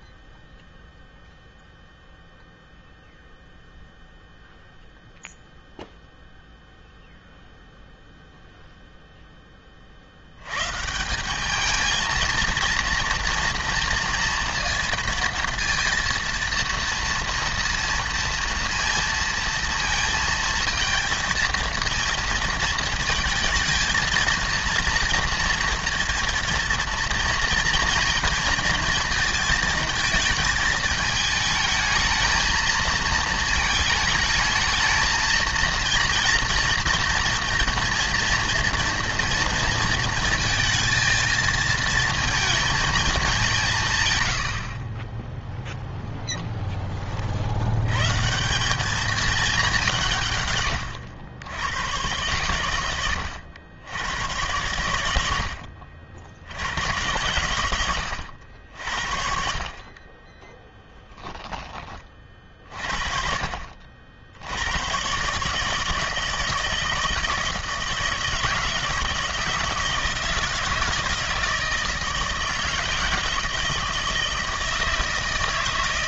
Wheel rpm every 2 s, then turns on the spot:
0, 0, 0, 0, 0, 130, 230, 230, 230, 230, 220, 220, 230, 230, 230, 220, 230, 220, 230, 230, 230, 220, 60, 10, 190, 110, 100, 100, 90, 70, 10, 40, 90, 160, 160, 160, 160, 160.
none